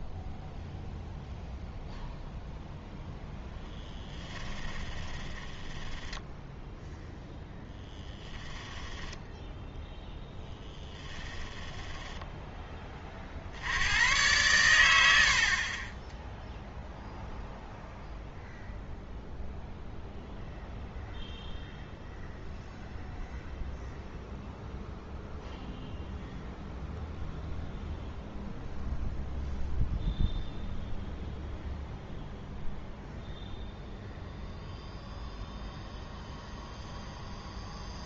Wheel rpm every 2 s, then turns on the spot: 0, 0, 20, 0, 10, 10, 10, 100, 0, 0, 0, 0, 0, 0, 0, 0, 0, 0, 0.
4-6 10-12